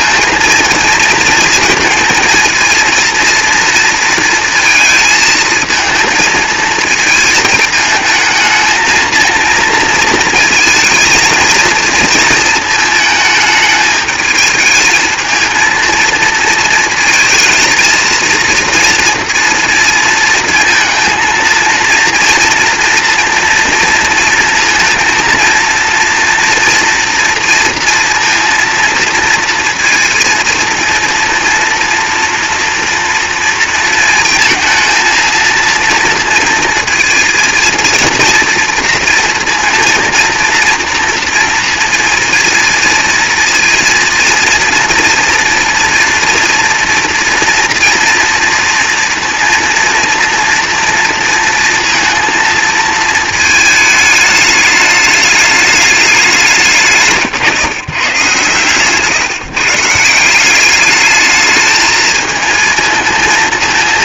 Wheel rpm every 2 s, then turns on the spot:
230, 230, 230, 220, 220, 230, 220, 220, 230, 230, 230, 230, 230, 230, 230, 230, 230, 230, 230, 240, 230, 230, 230, 230, 230, 230, 230, 210, 150, 130, 200, 220.
none